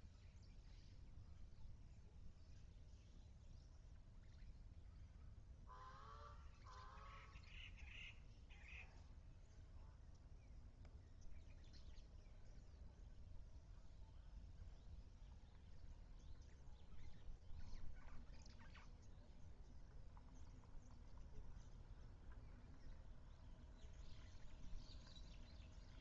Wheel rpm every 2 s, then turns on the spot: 0, 0, 0, 0, 0, 0, 0, 0, 0, 0, 0, 0, 0.
none